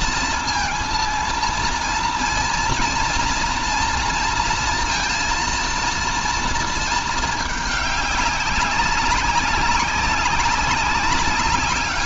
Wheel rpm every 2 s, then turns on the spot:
220, 230, 230, 220, 190, 190.
none